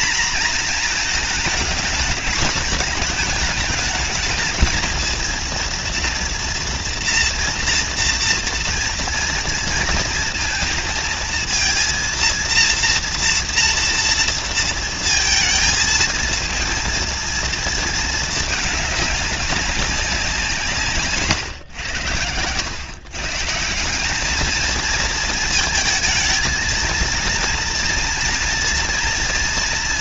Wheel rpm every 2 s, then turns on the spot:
230, 210, 220, 230, 230, 230, 240, 230, 230, 220, 180, 100, 220, 230, 240.
none